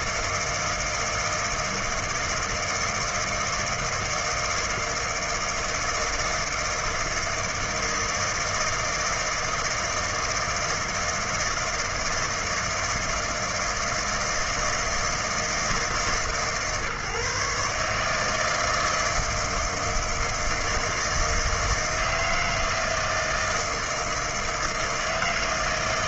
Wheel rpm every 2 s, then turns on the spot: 160, 160, 160, 160, 160, 160, 160, 160, 140, 160, 160, 160, 160.
none